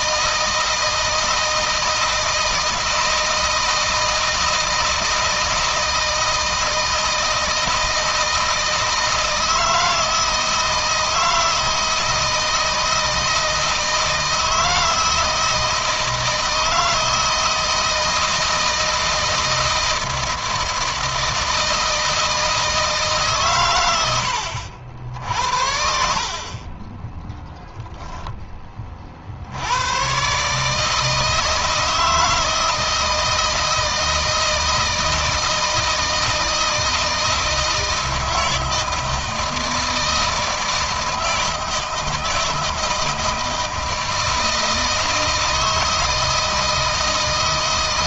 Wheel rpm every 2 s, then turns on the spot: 160, 160, 160, 160, 160, 160, 160, 160, 160, 160, 160, 160, 60, 20, 30, 150, 160, 160, 160, 160, 160, 160, 160, 160.
none